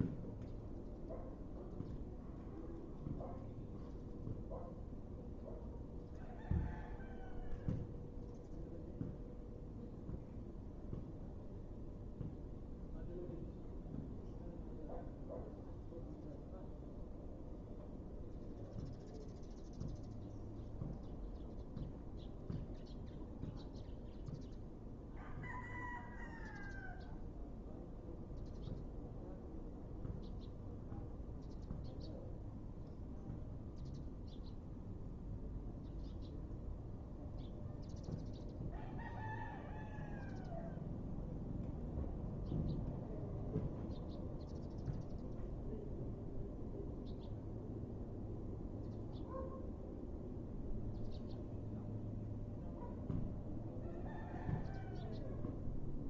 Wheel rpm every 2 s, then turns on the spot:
0, 0, 0, 0, 0, 0, 0, 0, 0, 0, 0, 0, 0, 0, 0, 0, 0, 0, 0, 0, 0, 0, 0, 0, 0, 0, 0, 0.
none